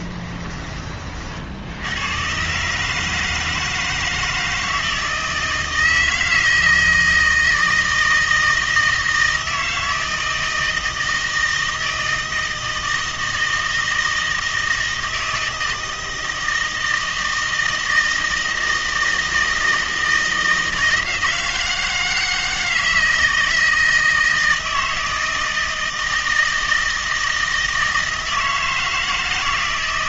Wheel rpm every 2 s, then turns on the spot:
30, 150, 160, 160, 160, 160, 160, 160, 160, 160, 160, 160, 160, 160, 160.
none